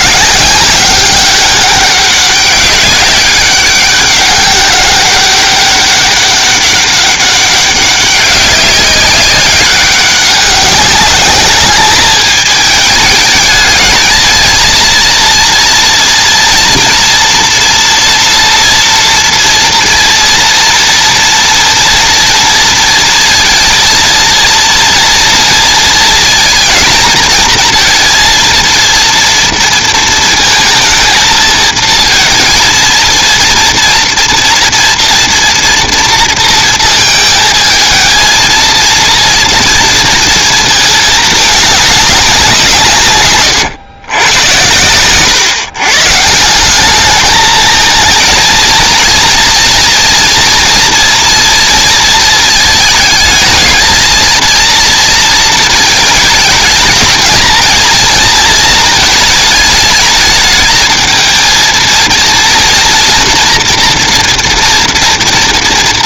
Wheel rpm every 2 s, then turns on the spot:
190, 200, 200, 200, 190, 200, 210, 230, 230, 230, 230, 230, 230, 230, 230, 230, 230, 230, 220, 230, 210, 130, 120, 210, 230, 230, 220, 230, 220, 220, 220, 230, 230.
none